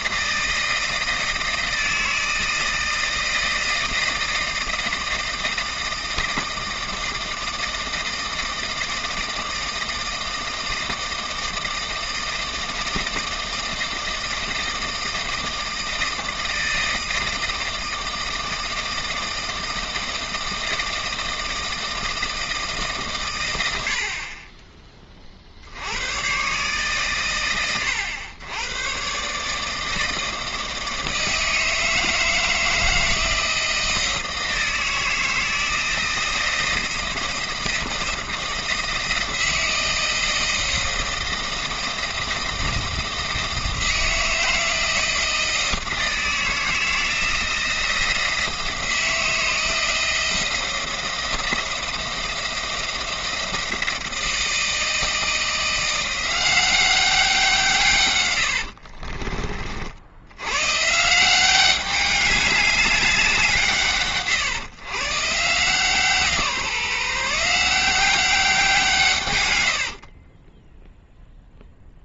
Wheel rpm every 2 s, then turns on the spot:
160, 160, 160, 160, 160, 160, 160, 160, 160, 160, 160, 150, 30, 130, 110, 160, 160, 160, 160, 160, 160, 160, 160, 160, 160, 170, 170, 160, 190, 70, 110, 200, 120, 160, 170, 10.
58-60 70-72